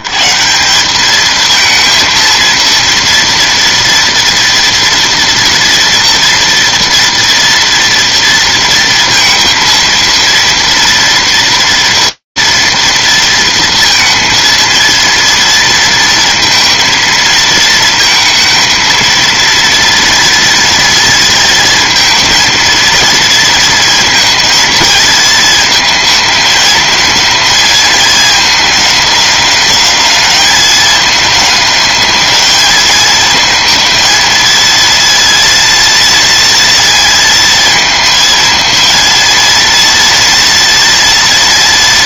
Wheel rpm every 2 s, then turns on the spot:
140, 230, 230, 230, 230, 230, 230, 230, 230, 230, 230, 230, 220, 220, 210, 210, 220, 230, 230, 230, 230.
none